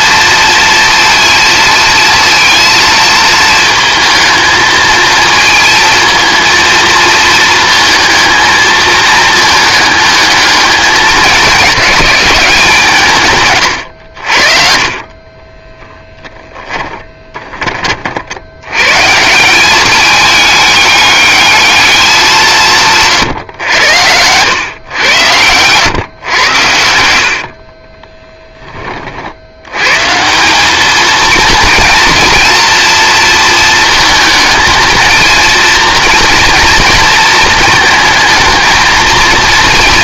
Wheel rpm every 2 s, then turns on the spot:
230, 230, 220, 230, 220, 200, 170, 30, 20, 140, 210, 150, 110, 70, 30, 210, 230, 230, 230, 220.
16-18